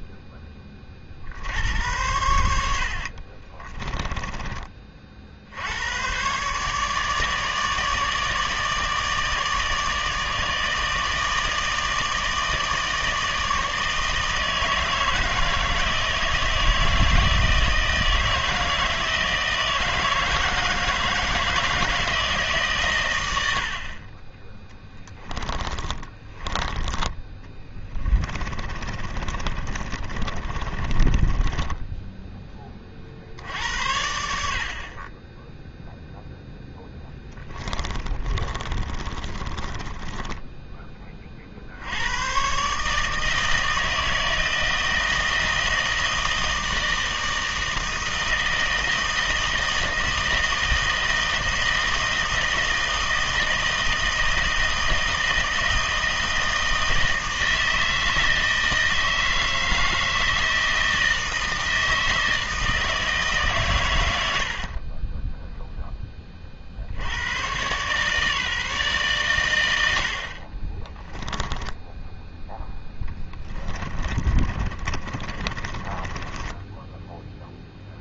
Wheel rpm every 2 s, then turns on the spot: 30, 70, 30, 140, 160, 160, 160, 160, 160, 160, 160, 140, 10, 20, 30, 30, 30, 50, 10, 30, 10, 140, 160, 160, 160, 160, 160, 160, 160, 160, 160, 160, 50, 50, 150, 30, 10, 30, 10.
2-4 24-26 28-32 36-40 64-66 70-72 74-78